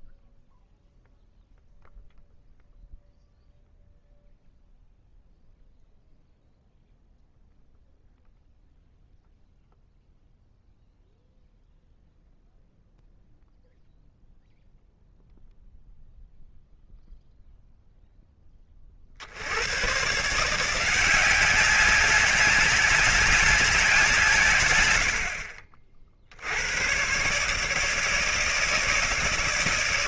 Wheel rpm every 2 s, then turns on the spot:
0, 0, 0, 0, 0, 0, 0, 0, 0, 10, 150, 190, 160, 70, 160.
none